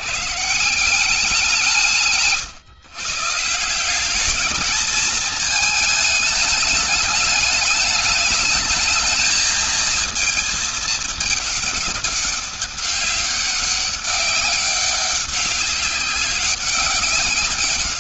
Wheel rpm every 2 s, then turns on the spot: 150, 140, 210, 210, 210, 220, 200, 200, 200.
none